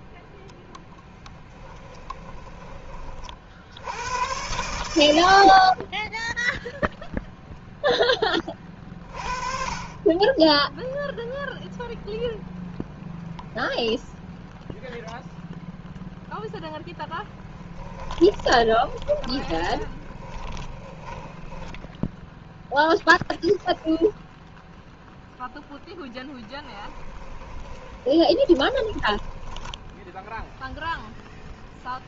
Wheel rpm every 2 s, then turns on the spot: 10, 20, 80, 0, 20, 10, 0, 0, 10, 20, 20, 10, 0, 10, 20, 0.
16-22 26-30